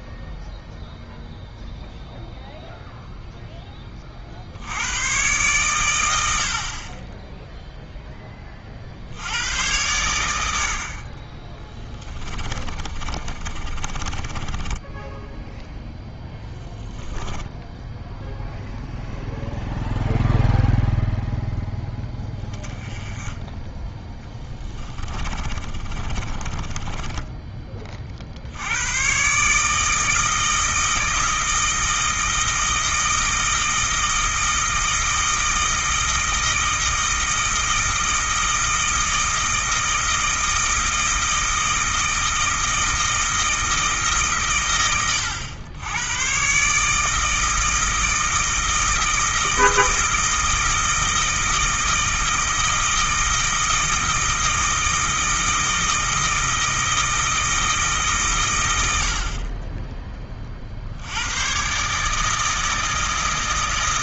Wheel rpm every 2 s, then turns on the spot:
0, 0, 90, 50, 50, 60, 30, 10, 10, 0, 0, 20, 20, 20, 100, 160, 160, 160, 160, 160, 160, 160, 120, 150, 160, 160, 160, 160, 160, 90, 60, 160.
12-18 24-28